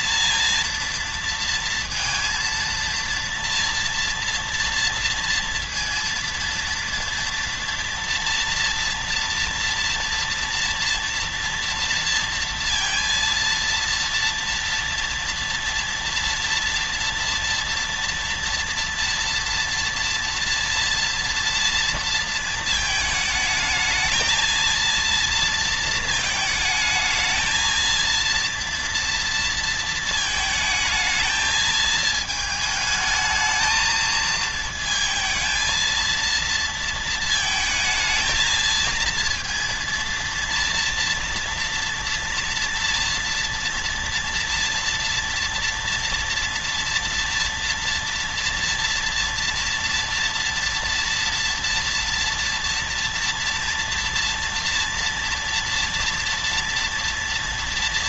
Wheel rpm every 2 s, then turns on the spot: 230, 230, 230, 230, 230, 230, 230, 230, 230, 230, 230, 220, 230, 220, 230, 220, 220, 230, 230, 230, 230, 230, 230, 230, 230, 230, 230, 230, 230.
none